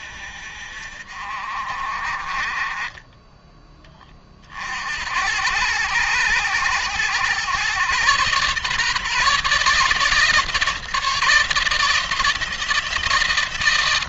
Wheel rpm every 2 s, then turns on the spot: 50, 20, 70, 100, 140, 160, 170.
none